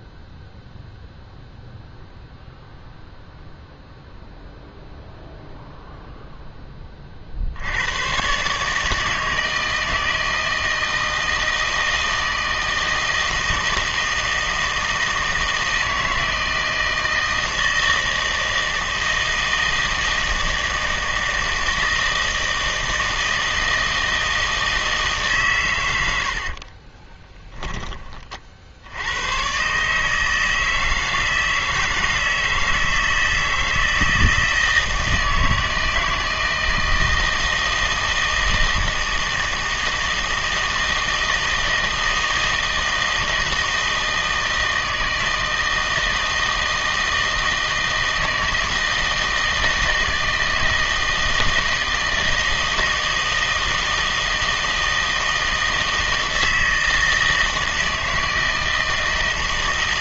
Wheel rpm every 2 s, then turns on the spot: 0, 0, 0, 20, 150, 160, 160, 160, 160, 160, 160, 160, 160, 30, 80, 160, 160, 160, 160, 160, 160, 160, 160, 160, 160, 160, 160, 160, 160, 160.
26-28